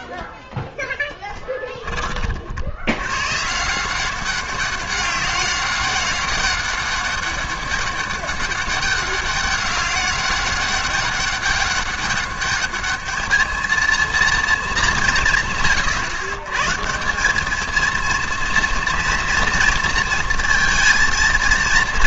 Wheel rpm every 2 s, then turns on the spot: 0, 70, 200, 200, 200, 200, 210, 210, 130, 230, 230.
none